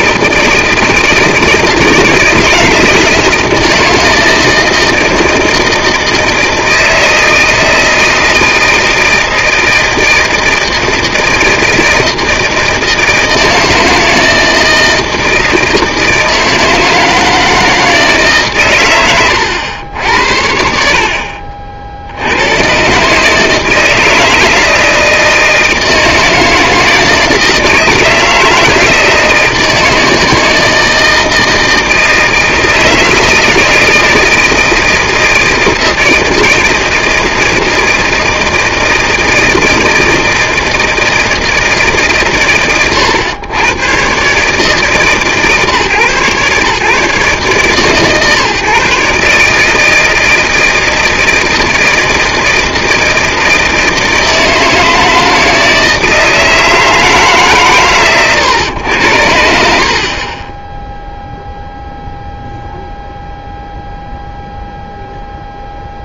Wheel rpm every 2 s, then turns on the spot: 160, 160, 160, 160, 160, 160, 160, 160, 160, 130, 70, 110, 160, 160, 160, 160, 160, 160, 160, 170, 160, 90, 140, 130, 150, 160, 160, 160, 160, 110, 20, 0, 0.
none